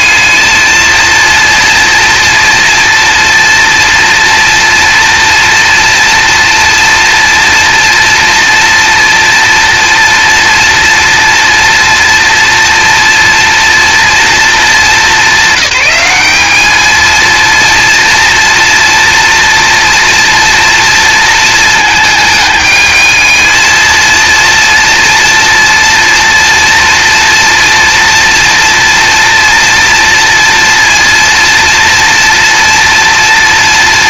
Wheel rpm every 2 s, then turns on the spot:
220, 230, 230, 240, 240, 230, 230, 220, 210, 240, 230, 210, 230, 230, 230, 230, 230.
none